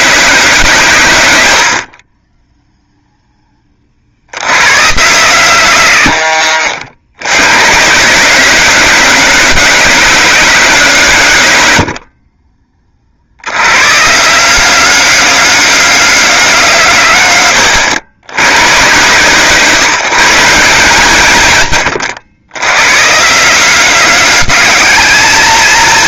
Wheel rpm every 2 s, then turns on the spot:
180, 10, 120, 120, 200, 200, 40, 200, 190, 130, 150, 120, 220.
none